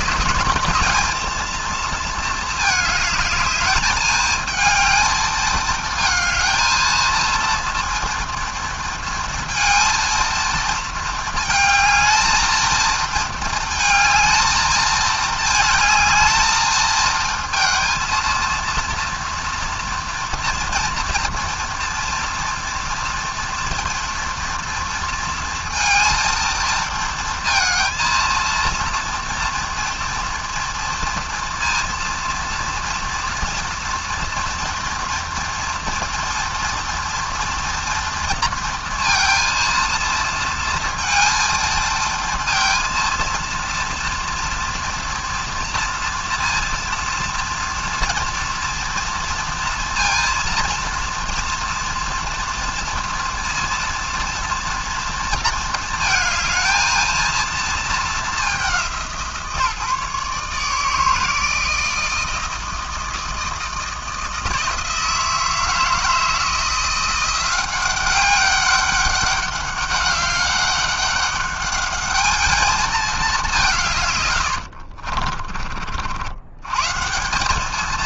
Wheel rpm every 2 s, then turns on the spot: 210, 220, 220, 230, 230, 230, 230, 220, 220, 230, 240, 230, 230, 230, 230, 230, 230, 240, 230, 230, 230, 230, 240, 230, 230, 230, 230, 230, 220, 200, 150, 160, 160, 160, 200, 200, 220, 70, 110.
74-76